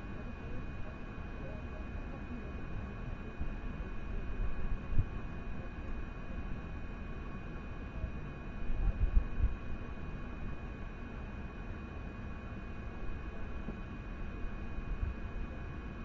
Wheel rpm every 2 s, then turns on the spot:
0, 0, 0, 0, 0, 0, 0, 0.
none